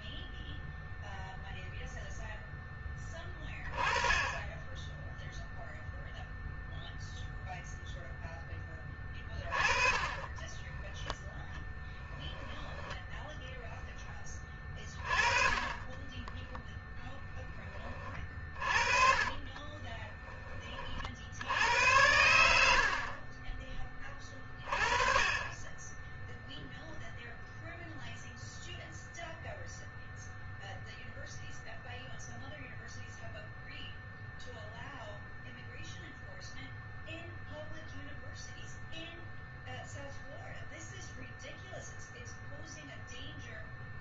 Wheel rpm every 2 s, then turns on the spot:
0, 10, 10, 0, 10, 10, 10, 20, 10, 30, 20, 80, 20, 0, 0, 0, 0, 0, 0, 0, 0, 0.
10-14 16-20